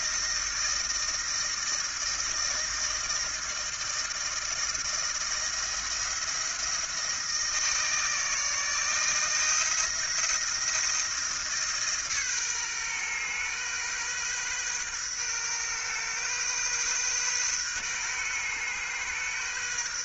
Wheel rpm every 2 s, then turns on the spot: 160, 160, 170, 170, 160, 170, 130, 130, 130, 120.
none